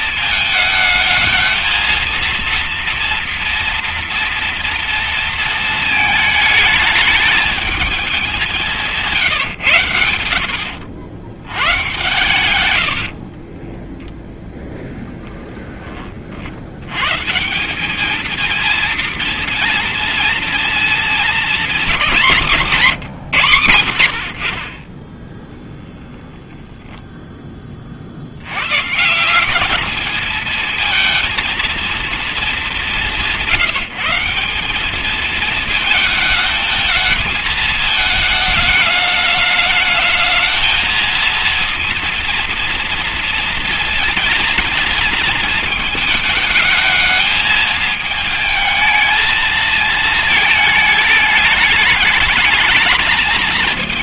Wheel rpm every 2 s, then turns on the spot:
220, 230, 230, 220, 190, 80, 110, 10, 70, 230, 230, 180, 30, 0, 110, 220, 210, 190, 220, 220, 220, 230, 220, 220, 220, 220, 220.
8-10 12-14